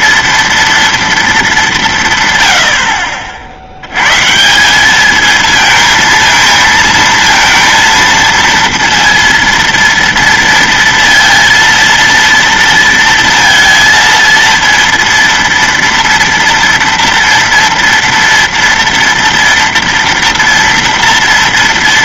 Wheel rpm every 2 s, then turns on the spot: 230, 150, 120, 220, 230, 230, 230, 230, 230, 230, 230.
none